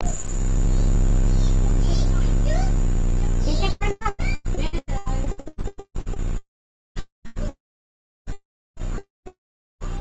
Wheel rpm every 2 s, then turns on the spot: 0, 0, 0, 0, 0.
none